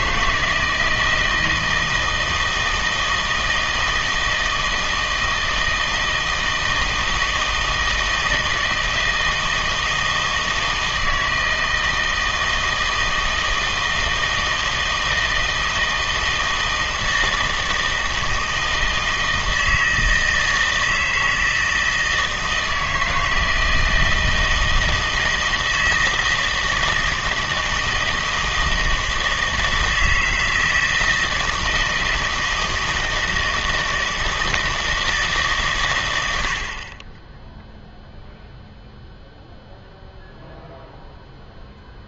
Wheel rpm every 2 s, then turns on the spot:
160, 160, 160, 160, 160, 160, 160, 160, 160, 160, 160, 160, 160, 160, 160, 160, 160, 160, 60, 0, 0.
none